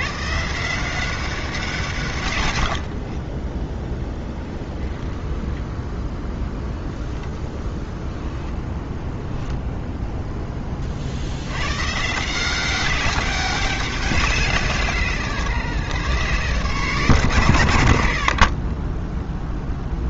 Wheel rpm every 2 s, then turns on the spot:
170, 70, 10, 10, 10, 30, 190, 150, 130, 30.
none